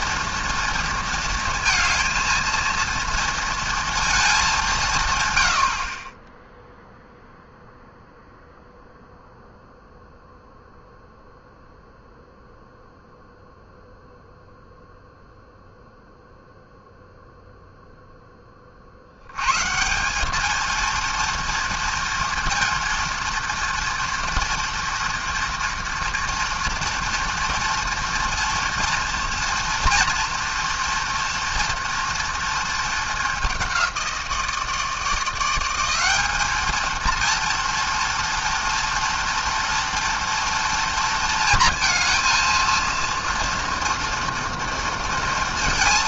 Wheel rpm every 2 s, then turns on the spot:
230, 230, 190, 0, 0, 0, 0, 0, 0, 30, 220, 230, 230, 230, 230, 230, 230, 160, 210, 230, 230, 230, 230.
none